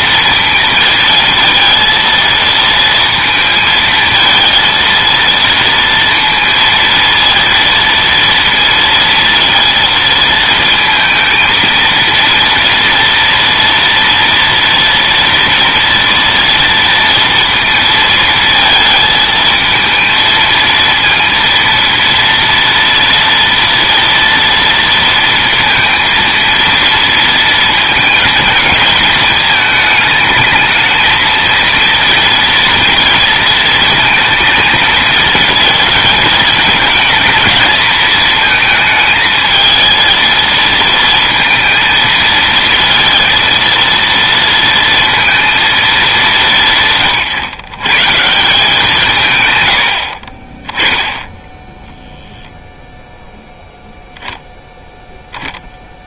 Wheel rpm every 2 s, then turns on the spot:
220, 230, 220, 230, 230, 220, 230, 230, 230, 220, 230, 230, 230, 230, 220, 220, 230, 220, 220, 220, 230, 230, 230, 150, 170, 20, 10, 0.
none